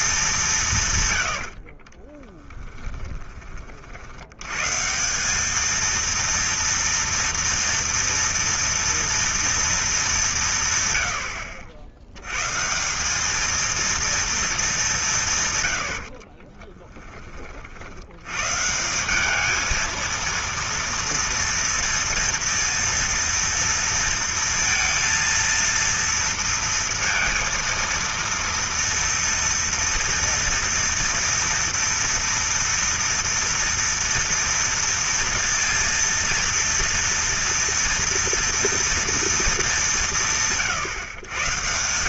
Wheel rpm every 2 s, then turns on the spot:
150, 10, 130, 230, 230, 130, 150, 200, 20, 160, 230, 230, 230, 230, 230, 230, 230, 240, 230, 230, 150.
2-4 16-18